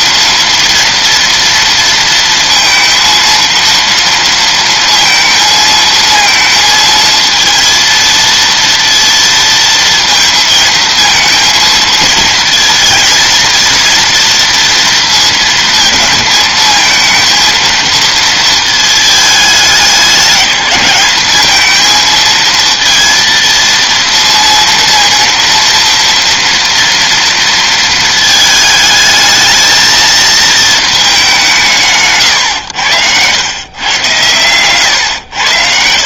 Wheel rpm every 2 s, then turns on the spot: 230, 230, 230, 230, 230, 220, 230, 230, 220, 220, 200, 230, 230, 230, 220, 220, 110, 110.
none